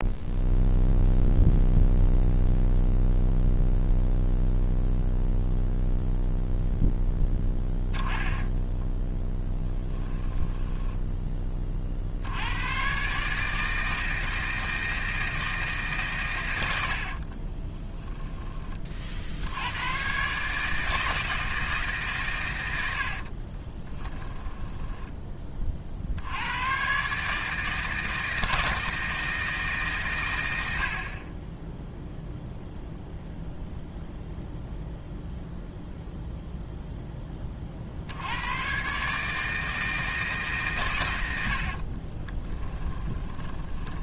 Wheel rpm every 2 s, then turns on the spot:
0, 0, 0, 0, 10, 10, 120, 160, 60, 30, 160, 80, 10, 120, 160, 80, 0, 0, 0, 130, 120, 20.
10-12 16-18 24-26 42-44